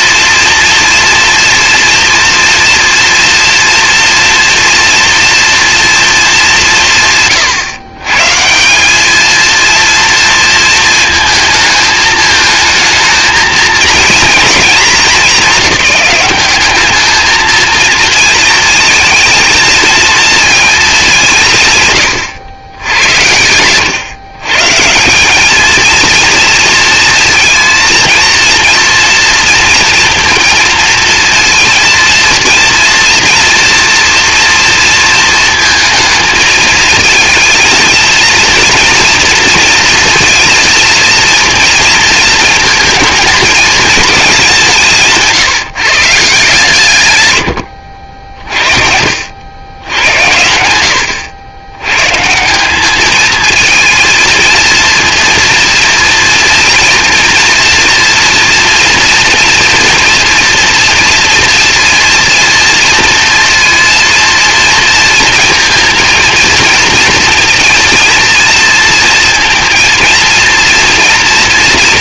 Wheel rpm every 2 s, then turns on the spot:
230, 240, 230, 170, 190, 230, 220, 220, 200, 230, 230, 90, 150, 230, 230, 220, 230, 230, 230, 240, 230, 230, 180, 140, 60, 100, 180, 230, 230, 230, 230, 230, 230, 230, 230, 230.
none